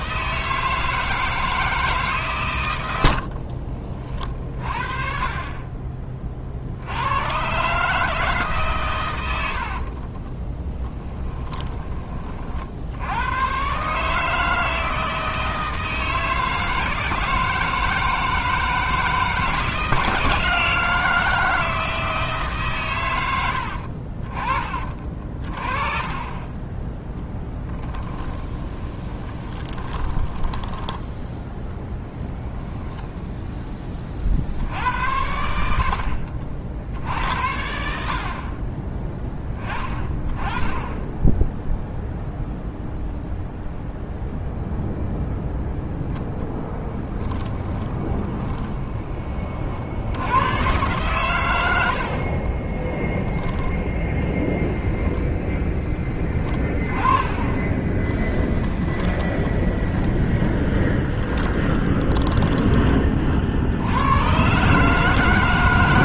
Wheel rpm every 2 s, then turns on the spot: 160, 90, 40, 80, 120, 10, 70, 160, 160, 160, 160, 130, 30, 10, 20, 10, 10, 70, 60, 10, 20, 0, 0, 10, 20, 120, 20, 10, 20, 20, 20, 20, 140.
10-12 28-30 32-34 46-50 52-54 58-62